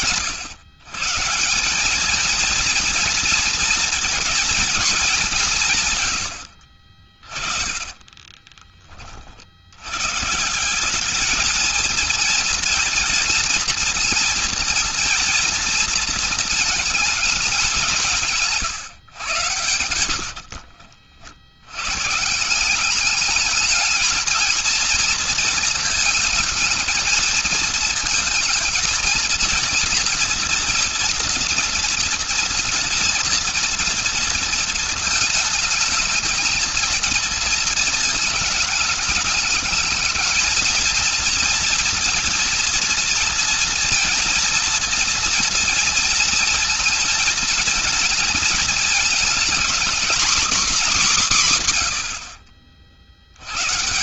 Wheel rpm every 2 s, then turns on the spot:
150, 230, 210, 60, 40, 200, 230, 230, 220, 130, 60, 210, 230, 220, 230, 240, 230, 220, 220, 210, 230, 240, 230, 230, 220, 200, 40.
none